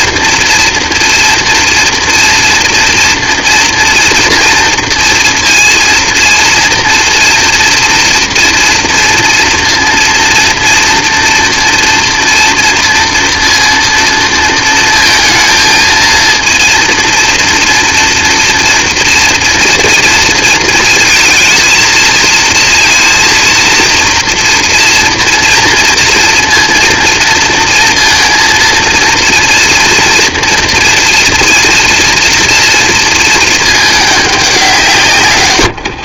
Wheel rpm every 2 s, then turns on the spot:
240, 230, 230, 230, 230, 230, 230, 230, 230, 230, 230, 230, 230, 230, 230, 230, 230, 190.
none